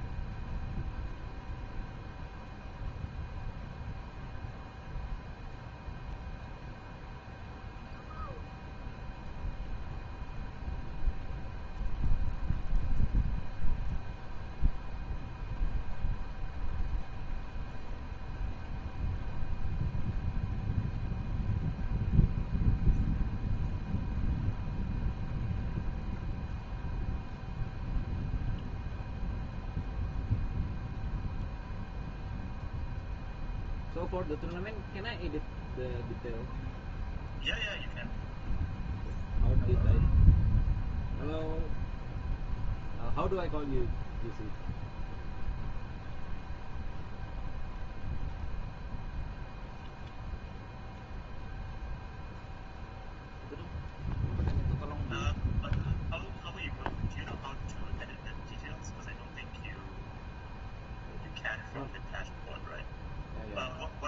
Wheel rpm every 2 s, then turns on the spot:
0, 0, 0, 0, 0, 0, 0, 0, 0, 0, 0, 0, 0, 0, 0, 0, 0, 0, 0, 0, 0, 0, 0, 0, 0, 0, 0, 0, 0, 0, 0, 0.
none